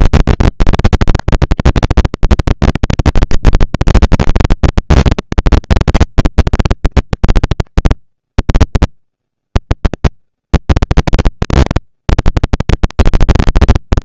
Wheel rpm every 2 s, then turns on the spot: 230, 220, 220, 190, 110, 180, 230.
none